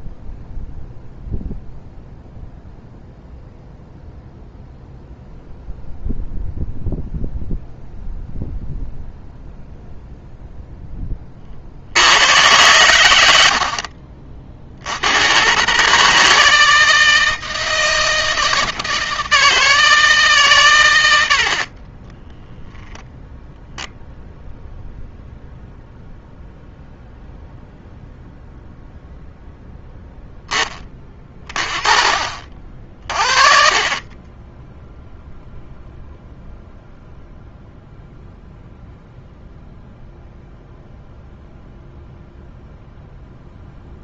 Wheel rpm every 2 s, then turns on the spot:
0, 0, 0, 0, 0, 0, 100, 50, 160, 160, 130, 0, 0, 0, 0, 10, 50, 10, 0, 0, 0, 0.
none